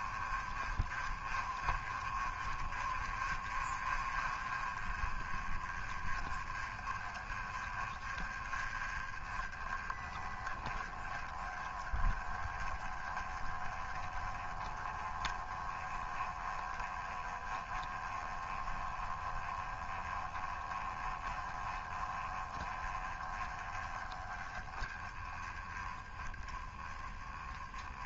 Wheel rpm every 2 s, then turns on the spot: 30, 20, 20, 20, 20, 20, 20, 20, 20, 20, 20, 20, 20, 10.
none